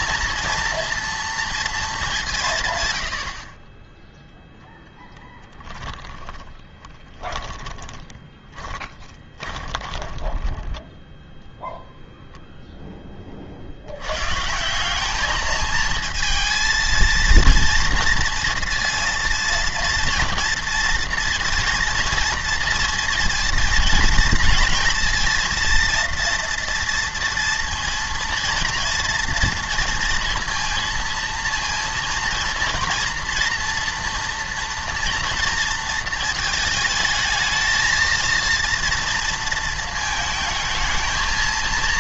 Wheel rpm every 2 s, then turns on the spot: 240, 130, 0, 20, 10, 10, 0, 170, 230, 230, 230, 230, 230, 230, 240, 230, 230, 230, 220, 230, 220.
6-12